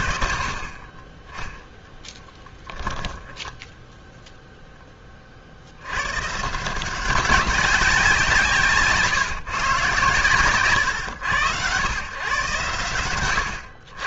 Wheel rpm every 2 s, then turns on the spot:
20, 10, 0, 160, 150, 120, 120.
none